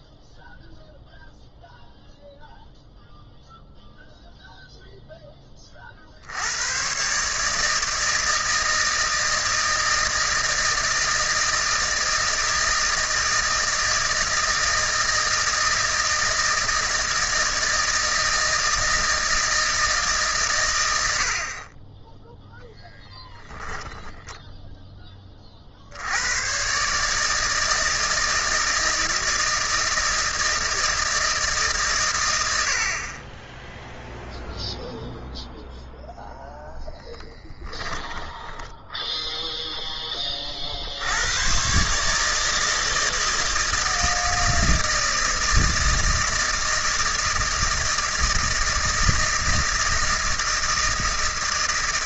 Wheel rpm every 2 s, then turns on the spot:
0, 0, 0, 100, 160, 160, 160, 160, 160, 160, 110, 0, 10, 130, 160, 160, 80, 0, 0, 10, 50, 160, 160, 160, 160, 160.
none